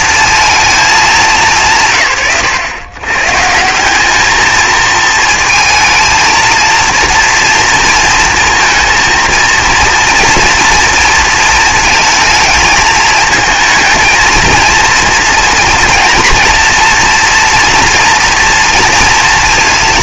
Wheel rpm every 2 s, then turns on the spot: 190, 130, 230, 230, 230, 230, 220, 230, 230, 230.
none